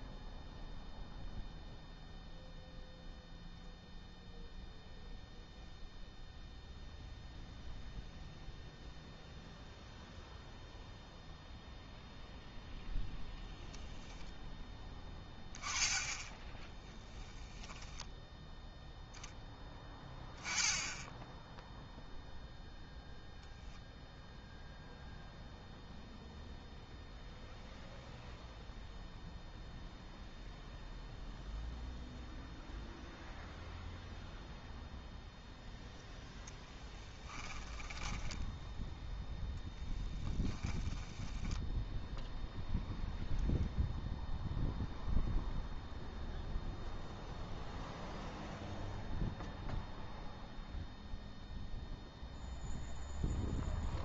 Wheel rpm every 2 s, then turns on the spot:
0, 0, 0, 0, 0, 0, 0, 10, 10, 0, 10, 0, 0, 0, 0, 0, 0, 0, 10, 10, 20, 0, 0, 0, 0, 0, 0.
16-18 38-42